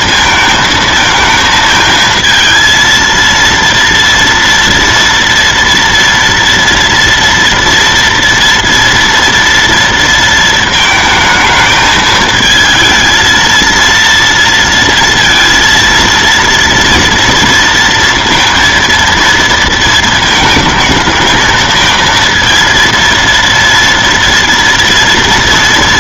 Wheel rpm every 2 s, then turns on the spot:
220, 230, 230, 230, 230, 220, 220, 230, 230, 230, 220, 230, 230.
none